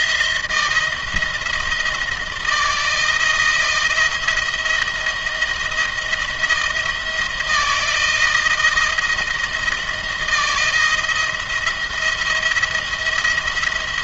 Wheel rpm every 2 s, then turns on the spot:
160, 160, 160, 160, 160, 160, 170.
none